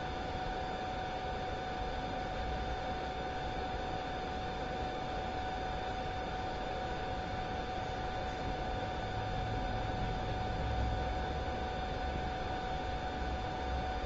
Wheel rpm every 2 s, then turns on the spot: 0, 0, 0, 0, 0, 0, 0.
none